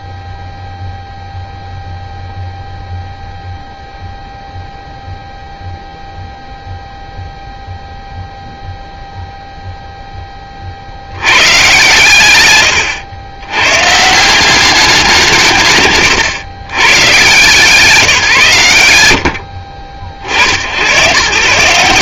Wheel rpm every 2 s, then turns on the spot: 0, 0, 0, 0, 0, 50, 110, 190, 100, 120, 100.
none